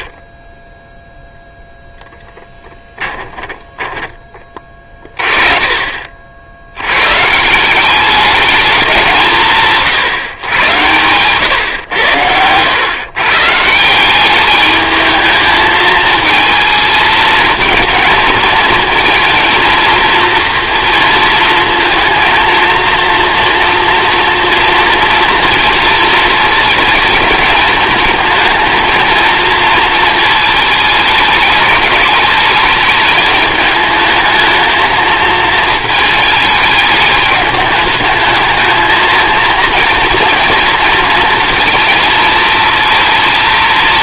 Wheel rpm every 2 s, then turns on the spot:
0, 10, 30, 90, 200, 120, 110, 210, 220, 220, 230, 230, 240, 230, 230, 220, 210, 220, 210, 220, 230, 230.
2-4